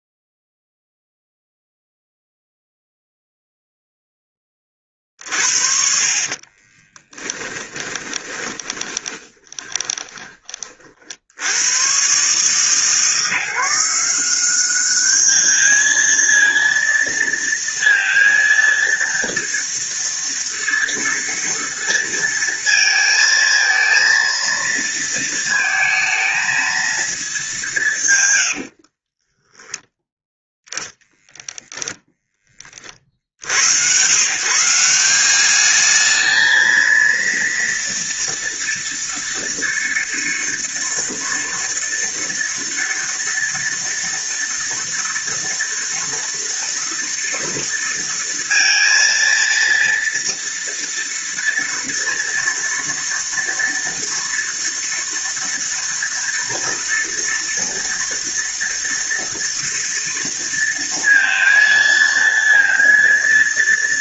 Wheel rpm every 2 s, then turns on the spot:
0, 0, 20, 30, 30, 30, 140, 190, 230, 230, 230, 230, 230, 220, 90, 10, 20, 140, 220, 230, 230, 230, 230, 230, 230, 230, 230, 230, 230, 230, 230, 230.
6-10 28-30